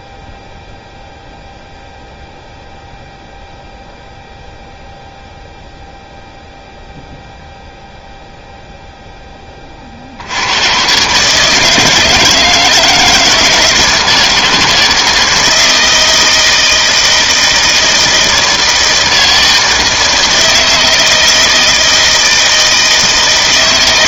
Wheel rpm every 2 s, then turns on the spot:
0, 0, 0, 0, 0, 110, 160, 160, 160, 160, 160, 160.
none